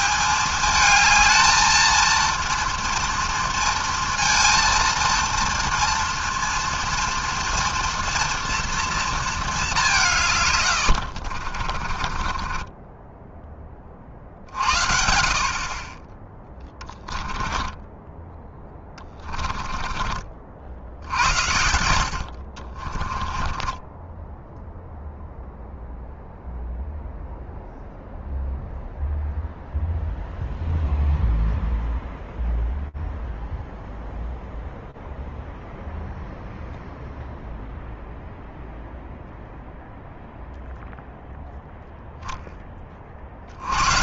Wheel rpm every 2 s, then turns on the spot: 210, 230, 230, 230, 230, 120, 30, 70, 10, 10, 60, 50, 0, 0, 0, 0, 0, 0, 0, 0, 0, 10.
10-14 16-20 22-24